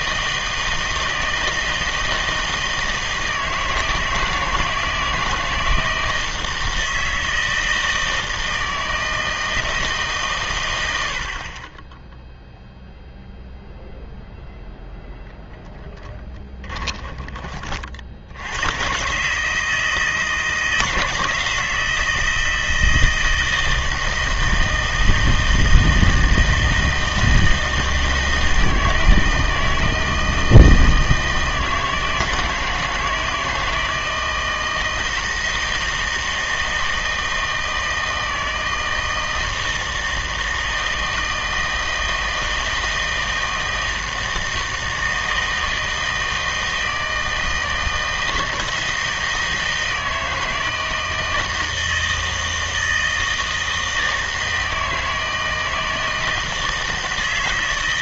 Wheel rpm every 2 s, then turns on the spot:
160, 160, 160, 160, 160, 110, 0, 10, 20, 100, 160, 160, 160, 160, 160, 160, 160, 160, 160, 160, 160, 160, 160, 160, 160, 160, 160, 160, 160.
16-18